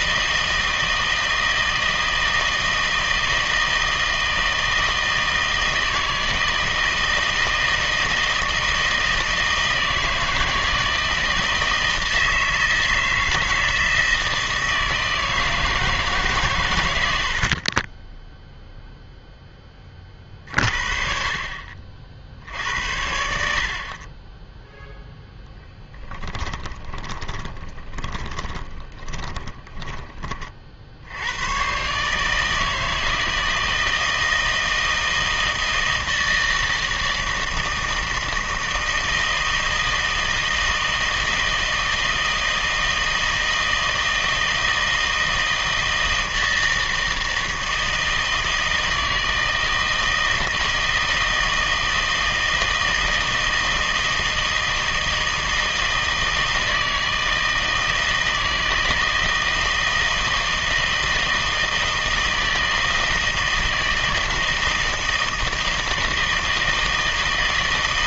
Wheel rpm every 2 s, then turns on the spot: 160, 160, 160, 160, 160, 160, 160, 160, 120, 0, 40, 70, 10, 10, 20, 50, 160, 160, 160, 160, 160, 160, 160, 160, 160, 160, 160, 160, 160, 160, 160, 160, 160, 160.
26-30